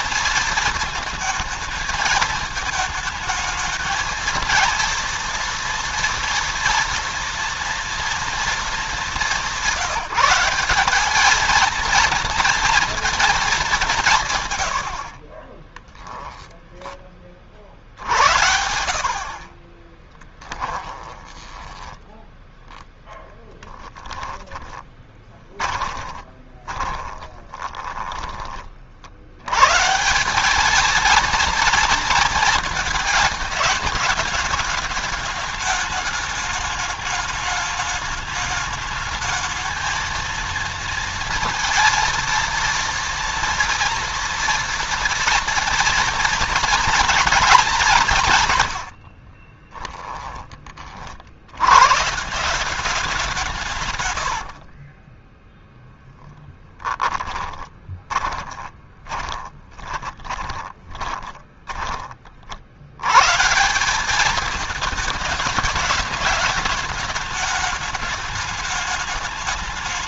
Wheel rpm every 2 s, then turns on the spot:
230, 220, 230, 230, 210, 200, 230, 90, 20, 70, 20, 10, 20, 20, 60, 220, 220, 210, 210, 220, 230, 230, 240, 230, 100, 40, 180, 40, 10, 20, 20, 80, 220, 210, 210.
20-22 24-28 48-50 54-62